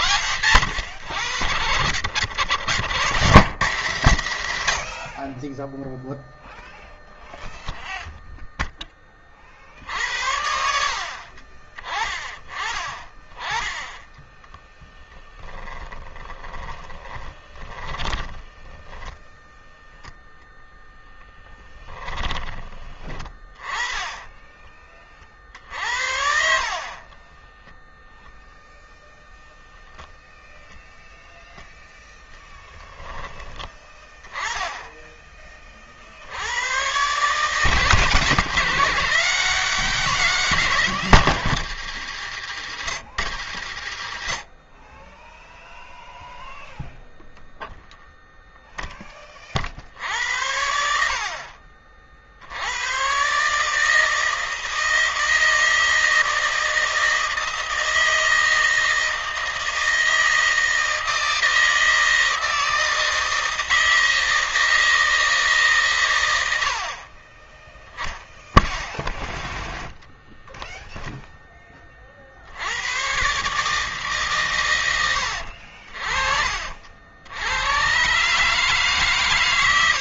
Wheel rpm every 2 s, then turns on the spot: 100, 90, 80, 0, 10, 70, 20, 10, 10, 20, 0, 20, 20, 50, 0, 0, 0, 20, 90, 150, 180, 110, 30, 0, 0, 70, 80, 160, 160, 160, 160, 160, 160, 80, 0, 0, 70, 130, 50, 140.
16-20 26-28